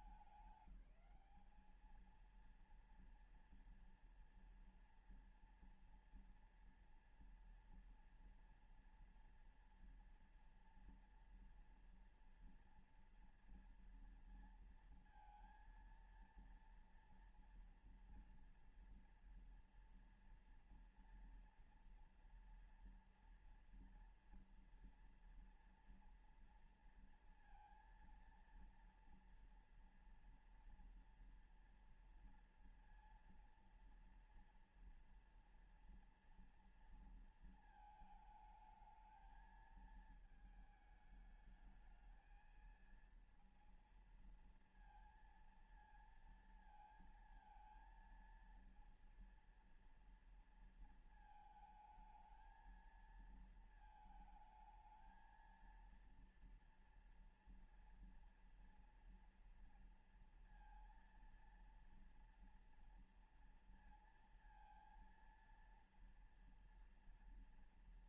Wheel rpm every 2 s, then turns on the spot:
200, 230, 230, 230, 230, 230, 230, 230, 240, 240, 230, 230, 230, 230, 230, 230, 230, 230, 230, 220, 220, 230, 230, 230, 230, 220, 220, 220, 230, 230, 230, 230, 230, 230.
none